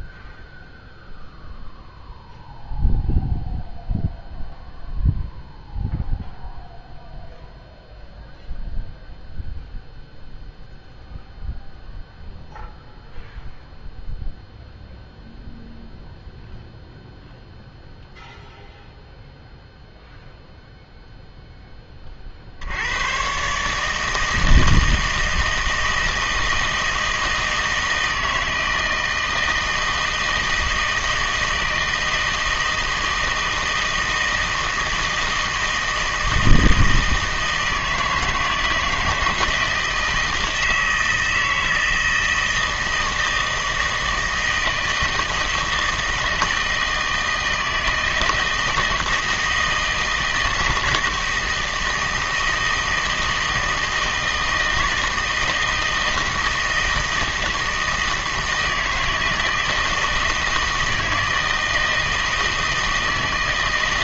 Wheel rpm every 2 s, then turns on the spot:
0, 0, 0, 0, 0, 0, 0, 0, 0, 0, 0, 70, 160, 160, 160, 160, 160, 160, 160, 160, 160, 160, 160, 170, 160, 160, 160, 160, 160, 160, 160, 160.
none